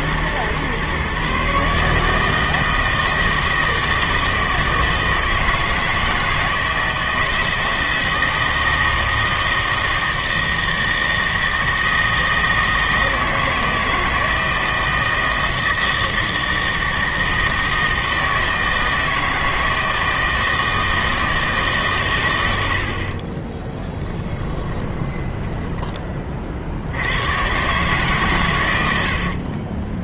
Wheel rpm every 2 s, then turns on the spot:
120, 160, 160, 160, 160, 160, 160, 160, 160, 160, 160, 80, 10, 60, 100.
24-26